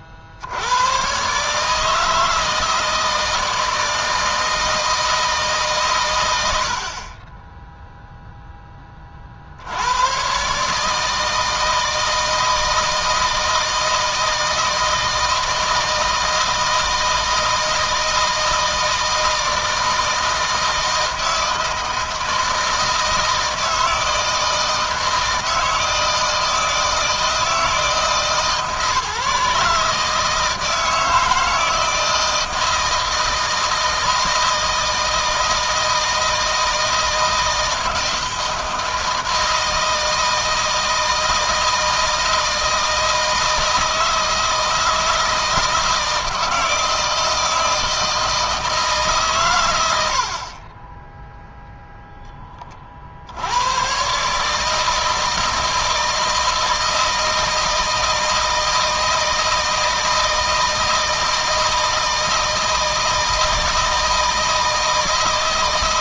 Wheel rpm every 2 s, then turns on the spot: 80, 160, 160, 90, 10, 130, 160, 160, 160, 160, 160, 160, 160, 160, 160, 160, 160, 160, 160, 160, 160, 170, 160, 160, 160, 50, 20, 140, 160, 160, 160, 160, 160.
none